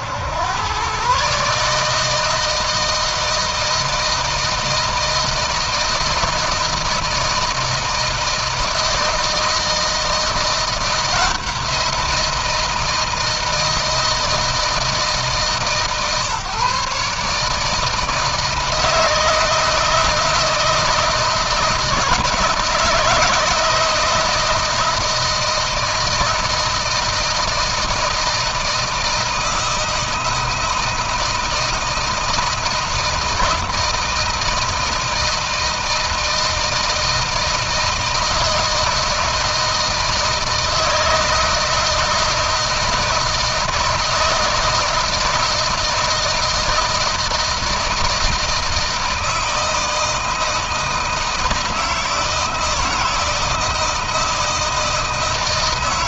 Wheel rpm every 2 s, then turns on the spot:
120, 160, 160, 160, 160, 170, 160, 160, 150, 160, 170, 170, 160, 160, 160, 160, 160, 160, 160, 160, 160, 160, 160, 160, 160, 160, 160, 160.
none